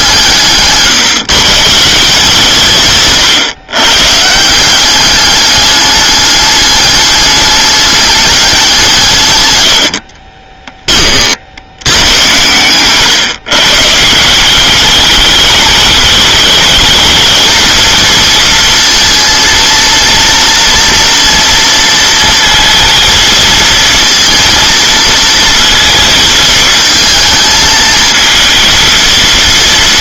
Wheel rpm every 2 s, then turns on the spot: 140, 140, 190, 210, 170, 10, 110, 200, 210, 230, 230, 230, 230, 230, 230.
none